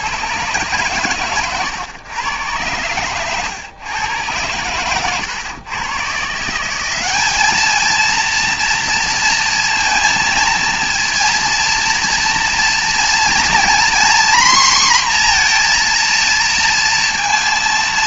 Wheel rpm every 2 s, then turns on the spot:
120, 100, 110, 180, 230, 230, 230, 250, 230.
4-6